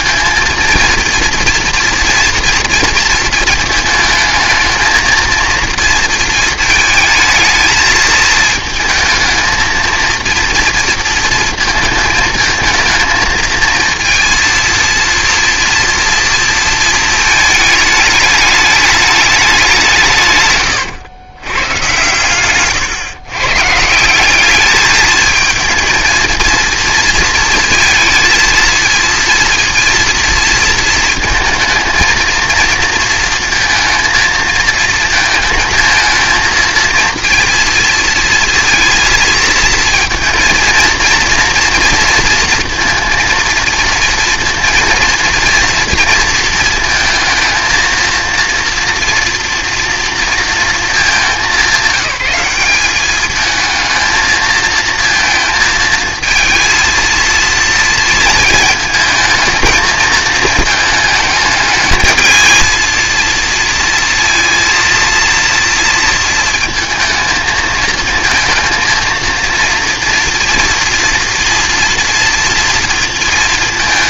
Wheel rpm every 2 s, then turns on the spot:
230, 230, 220, 220, 230, 230, 230, 230, 230, 210, 120, 120, 200, 230, 230, 230, 230, 220, 220, 230, 230, 230, 230, 230, 230, 220, 190, 220, 230, 220, 220, 220, 230, 230, 230, 230, 230.
22-24